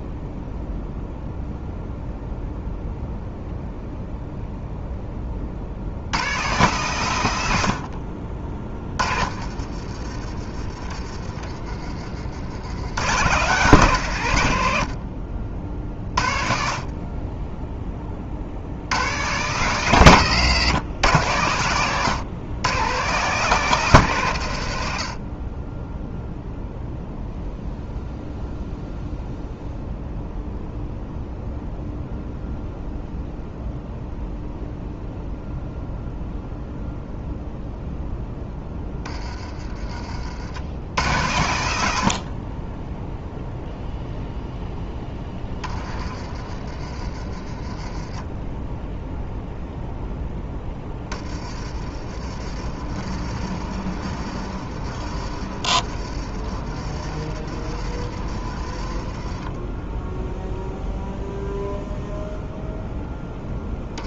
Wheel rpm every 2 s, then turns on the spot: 0, 0, 0, 130, 40, 30, 80, 90, 50, 70, 130, 130, 90, 0, 0, 0, 0, 0, 0, 10, 80, 30, 0, 30, 10, 10, 40, 40, 40, 30, 0, 0.
8-10 46-48 52-60